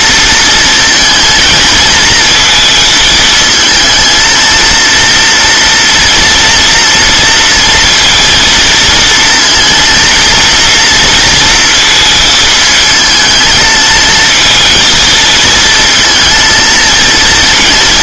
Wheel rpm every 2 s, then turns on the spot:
230, 220, 230, 230, 230, 230, 220, 230, 230.
none